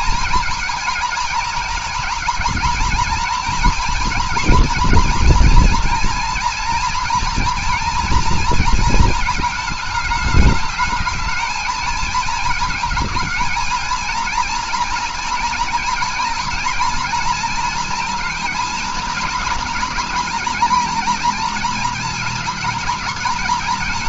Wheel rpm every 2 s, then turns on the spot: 230, 230, 230, 240, 230, 220, 220, 230, 230, 230, 240, 230.
none